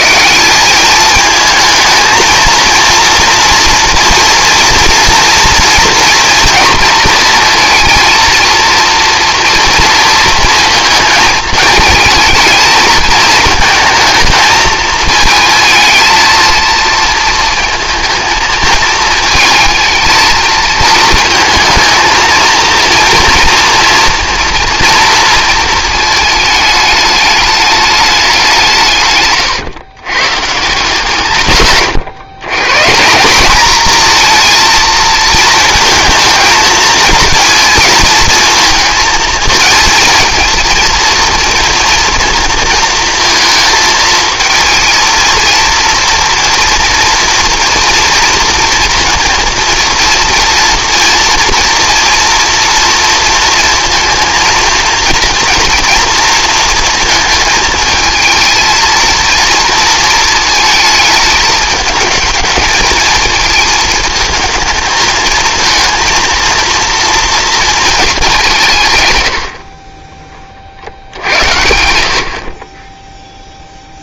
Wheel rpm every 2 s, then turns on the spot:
190, 230, 240, 230, 230, 230, 220, 220, 230, 230, 220, 230, 230, 210, 160, 140, 130, 230, 230, 230, 230, 230, 220, 230, 230, 230, 240, 230, 230, 230, 220, 220, 220, 230, 170, 40, 30.
none